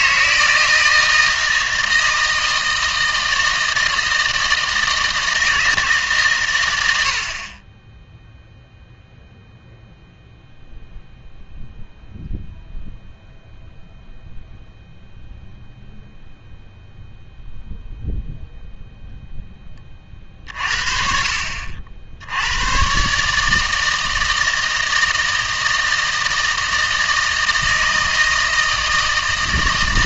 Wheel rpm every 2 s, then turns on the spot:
160, 160, 160, 100, 0, 0, 0, 0, 0, 0, 50, 110, 160, 160, 160.
none